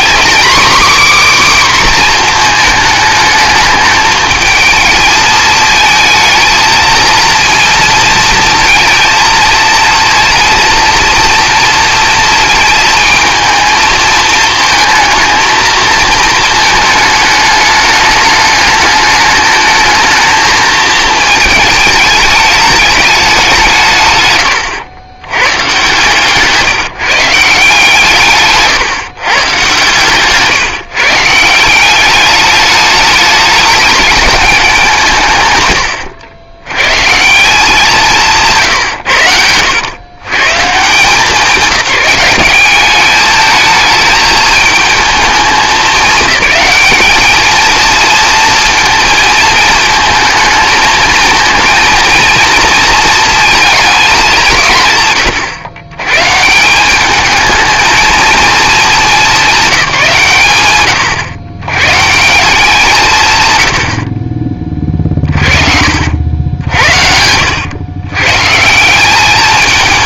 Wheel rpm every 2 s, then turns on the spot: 280, 220, 220, 220, 230, 230, 230, 220, 220, 210, 220, 210, 100, 160, 140, 150, 210, 190, 110, 140, 160, 200, 220, 210, 230, 220, 230, 170, 180, 220, 120, 180, 30, 70, 170.
66-68